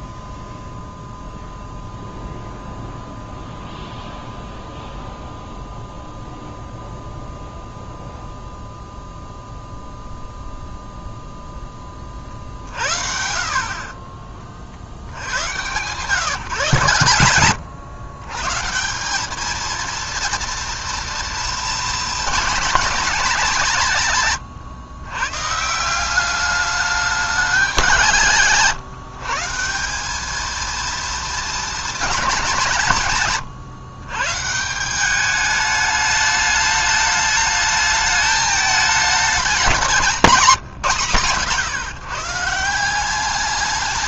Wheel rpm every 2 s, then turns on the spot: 0, 0, 0, 0, 0, 0, 50, 40, 140, 150, 230, 220, 130, 200, 150, 220, 190, 150, 210, 210, 160, 160.
none